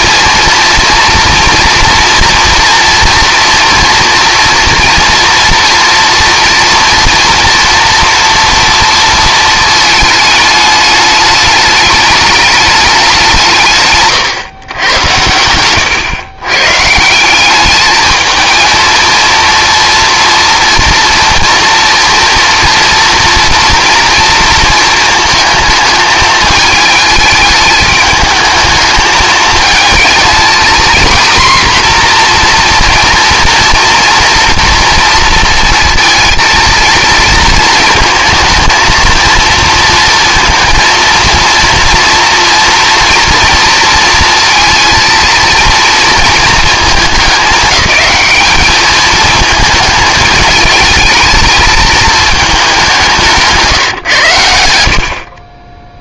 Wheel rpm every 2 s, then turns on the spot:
230, 230, 230, 230, 230, 210, 210, 120, 140, 220, 240, 230, 230, 220, 220, 240, 240, 230, 230, 230, 230, 240, 230, 220, 210, 210, 200, 90.
none